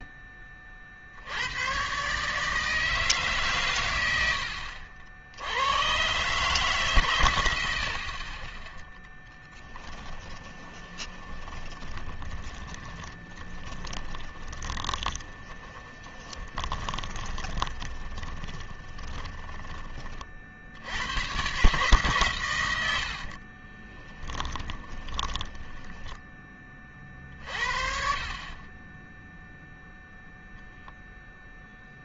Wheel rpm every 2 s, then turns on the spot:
40, 160, 60, 140, 10, 10, 30, 20, 20, 20, 70, 90, 20, 30, 20, 0.
10-20 24-26